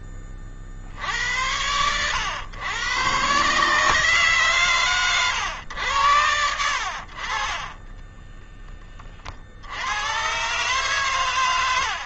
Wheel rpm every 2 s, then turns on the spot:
40, 110, 140, 90, 10, 120.
8-10